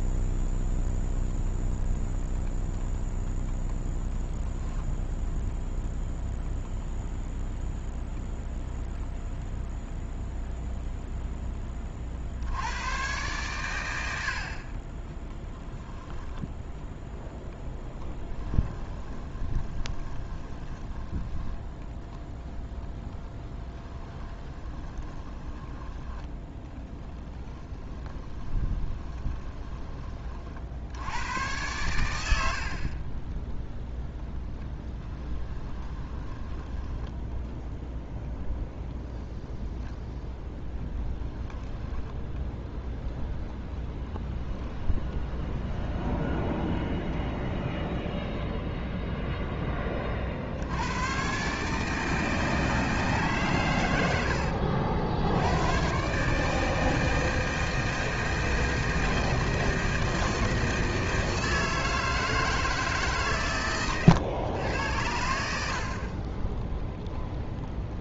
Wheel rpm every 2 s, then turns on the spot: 0, 0, 0, 0, 0, 0, 110, 20, 0, 20, 20, 10, 20, 10, 20, 90, 40, 20, 10, 0, 10, 0, 10, 20, 0, 100, 160, 70, 160, 160, 160, 150, 90, 0.
18-30 34-38 40-42 44-48